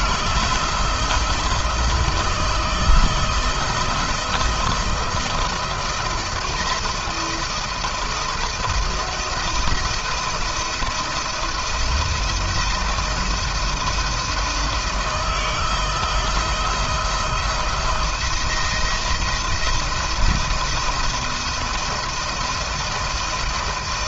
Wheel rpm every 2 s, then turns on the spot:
160, 160, 160, 170, 170, 170, 170, 160, 160, 170, 170, 170.
none